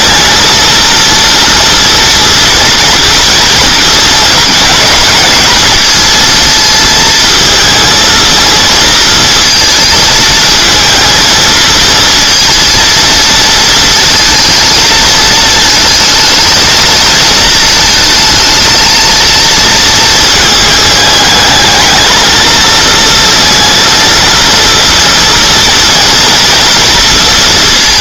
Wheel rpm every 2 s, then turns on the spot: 230, 230, 220, 230, 230, 230, 230, 220, 220, 220, 220, 230, 240, 230.
none